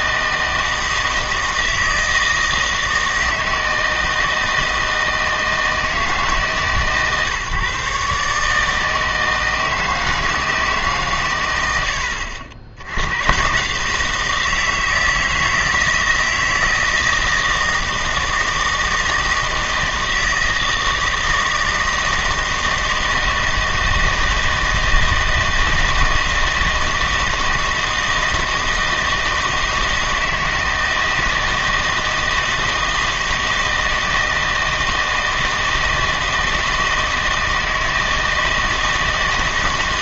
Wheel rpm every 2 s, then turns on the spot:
160, 160, 160, 140, 160, 150, 80, 160, 160, 160, 160, 160, 160, 160, 160, 160, 160, 160, 160, 160.
none